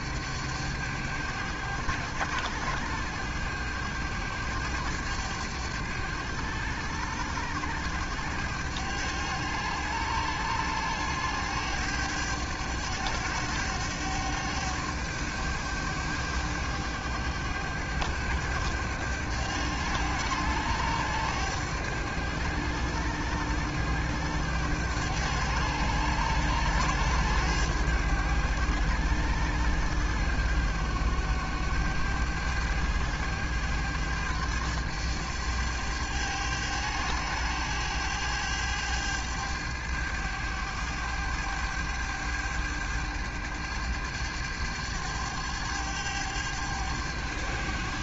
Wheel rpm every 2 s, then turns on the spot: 100, 100, 100, 100, 100, 100, 100, 100, 100, 100, 100, 100, 100, 100, 100, 100, 100, 100, 100, 100, 100, 100, 100, 100.
none